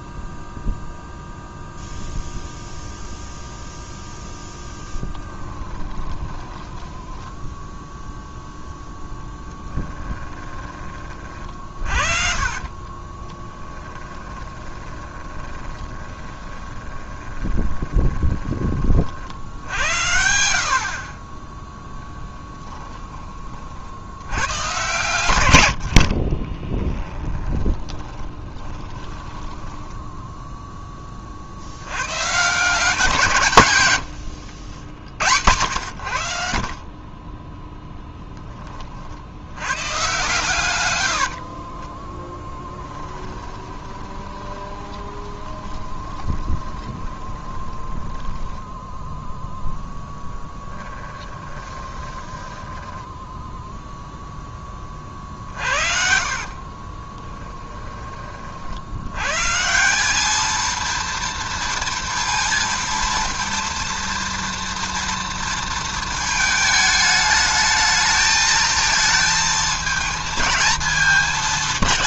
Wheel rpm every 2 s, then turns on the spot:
0, 0, 10, 10, 0, 30, 30, 20, 20, 50, 60, 20, 120, 10, 20, 10, 170, 90, 40, 40, 100, 10, 20, 20, 10, 20, 10, 20, 30, 80, 230, 230, 230, 220, 220, 220.
4-8 12-18 26-30 42-52 56-58